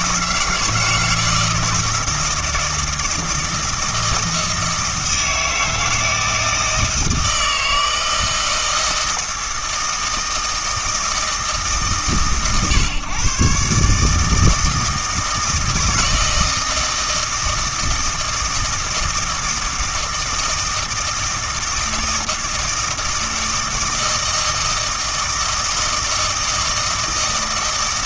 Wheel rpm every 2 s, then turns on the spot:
160, 160, 160, 160, 160, 160, 130, 160, 160, 160, 160, 160, 160, 160.
none